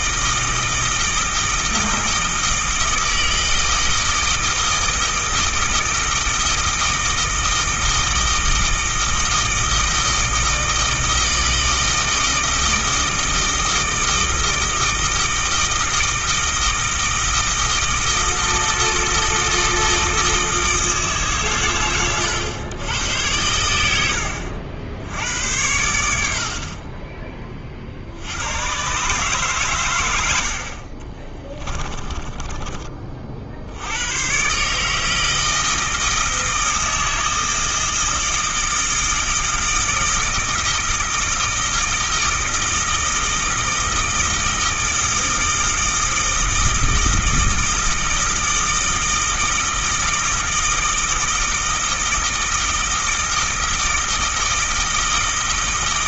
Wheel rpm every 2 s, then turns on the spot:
160, 160, 160, 160, 160, 160, 160, 160, 160, 160, 160, 110, 80, 40, 130, 40, 30, 150, 160, 160, 160, 160, 160, 160, 160, 160, 160, 160.
none